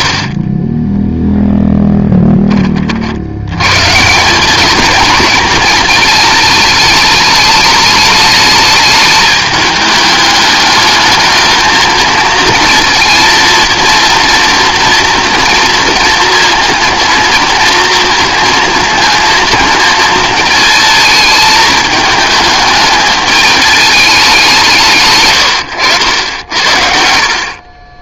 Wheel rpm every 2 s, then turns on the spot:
40, 40, 200, 210, 220, 210, 230, 230, 230, 220, 220, 210, 160, 60.
0-2 26-28